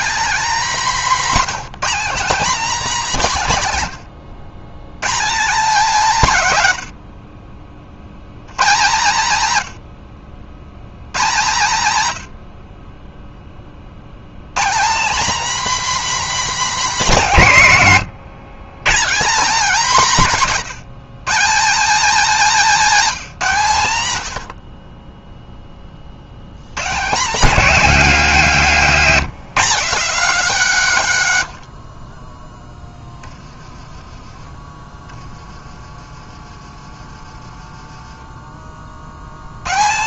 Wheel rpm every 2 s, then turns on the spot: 240, 260, 150, 80, 120, 110, 30, 220, 270, 140, 170, 230, 40, 140, 170, 180, 20, 20, 30, 50.
32-34